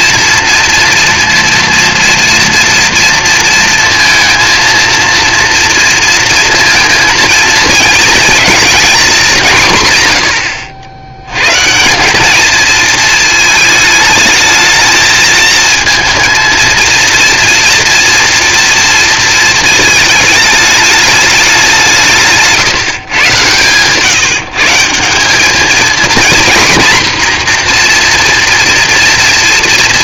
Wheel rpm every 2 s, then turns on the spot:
230, 230, 230, 230, 230, 100, 230, 220, 230, 230, 210, 150, 160, 240, 230.
none